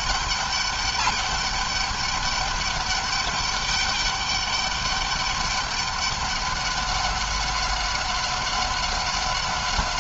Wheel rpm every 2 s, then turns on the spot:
200, 200, 200, 200, 190.
none